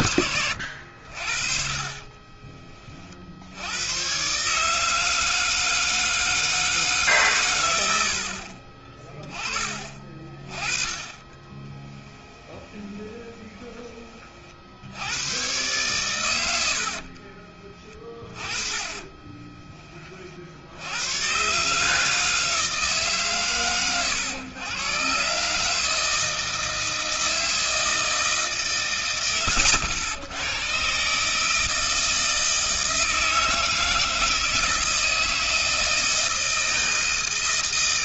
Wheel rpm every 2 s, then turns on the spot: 60, 40, 150, 160, 40, 20, 20, 80, 60, 20, 90, 150, 120, 160, 130, 120, 160, 160, 160.
12-14 16-20